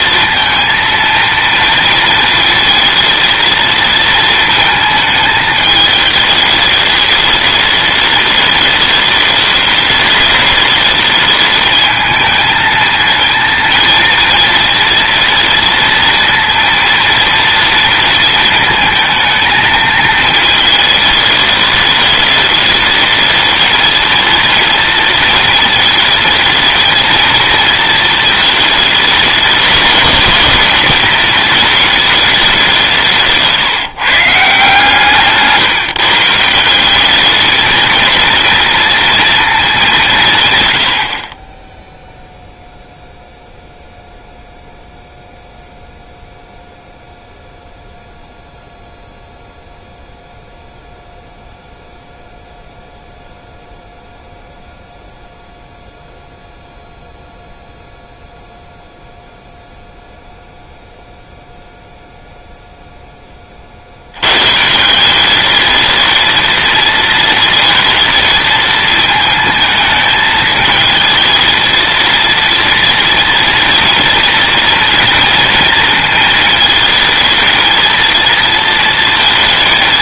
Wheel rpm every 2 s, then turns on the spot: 230, 230, 220, 210, 210, 210, 220, 230, 230, 220, 210, 220, 230, 220, 210, 220, 180, 160, 180, 230, 90, 0, 0, 0, 0, 0, 0, 0, 0, 0, 0, 0, 170, 230, 220, 220, 230, 230, 220, 230.
none